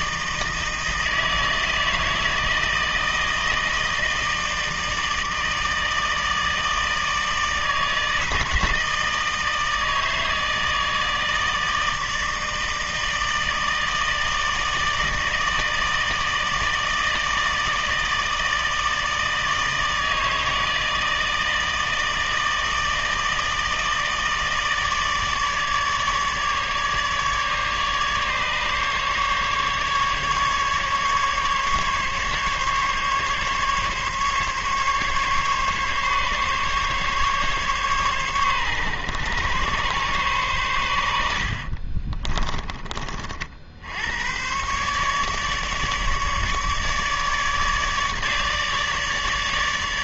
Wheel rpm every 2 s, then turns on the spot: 160, 160, 160, 160, 160, 160, 160, 160, 160, 160, 160, 160, 150, 150, 140, 150, 140, 140, 140, 120, 100, 30, 140, 150, 150.
none